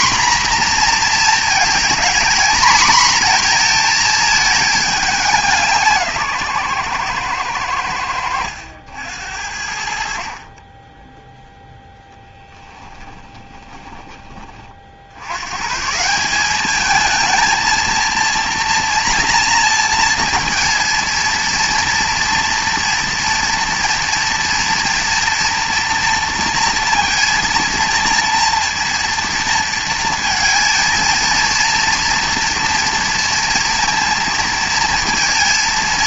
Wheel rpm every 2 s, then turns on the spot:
240, 230, 220, 130, 80, 30, 10, 40, 200, 230, 230, 230, 240, 230, 230, 230, 230, 230.
12-14